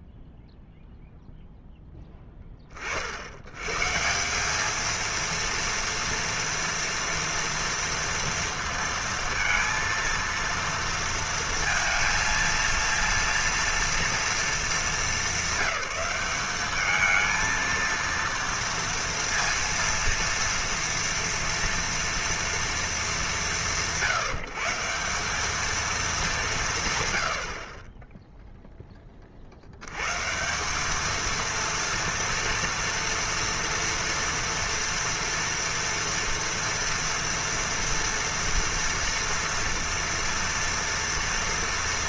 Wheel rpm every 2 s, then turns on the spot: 30, 230, 240, 230, 230, 230, 240, 200, 230, 230, 230, 160, 210, 0, 140, 230, 230, 230, 230, 230, 230.
none